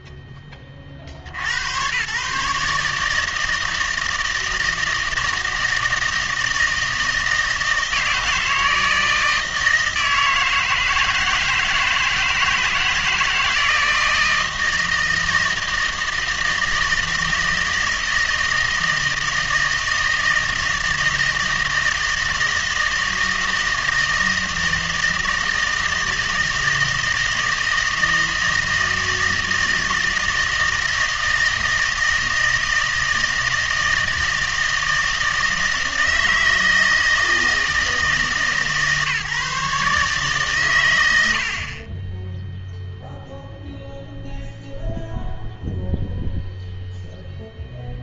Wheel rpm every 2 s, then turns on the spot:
50, 160, 160, 160, 160, 160, 160, 160, 160, 160, 160, 160, 160, 160, 160, 160, 160, 160, 160, 150, 100, 0, 0, 0.
none